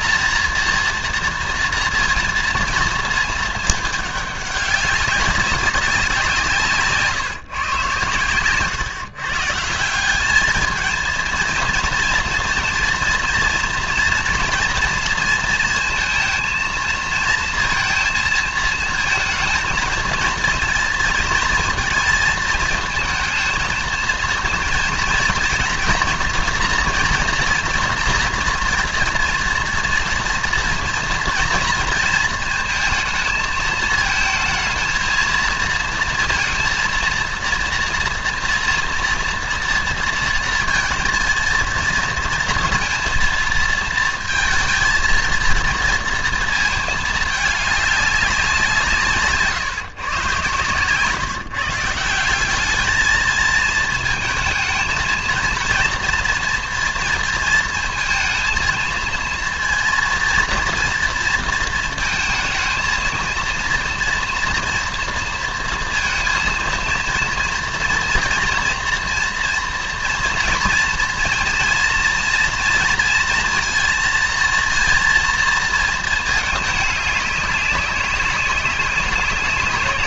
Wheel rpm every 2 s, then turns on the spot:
230, 230, 190, 150, 130, 220, 230, 230, 230, 230, 230, 220, 230, 230, 230, 230, 220, 220, 230, 230, 230, 230, 220, 220, 170, 120, 200, 220, 230, 230, 230, 230, 230, 230, 230, 230, 230, 230, 210, 190.
none